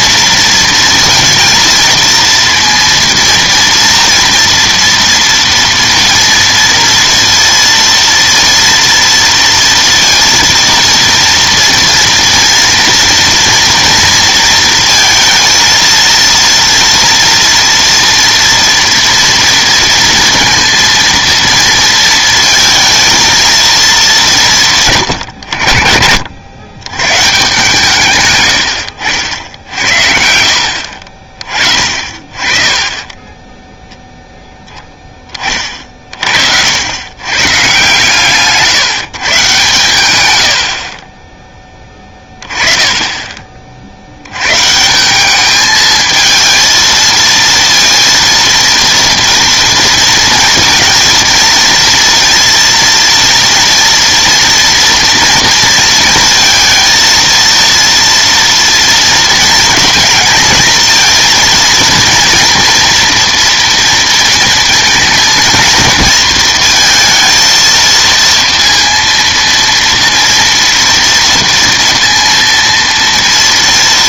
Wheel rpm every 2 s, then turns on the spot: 230, 230, 230, 230, 230, 230, 230, 230, 230, 230, 230, 230, 160, 80, 100, 70, 30, 0, 60, 140, 70, 20, 130, 220, 230, 230, 230, 230, 230, 230, 230, 230, 230, 220, 230, 230, 230.
30-32 40-42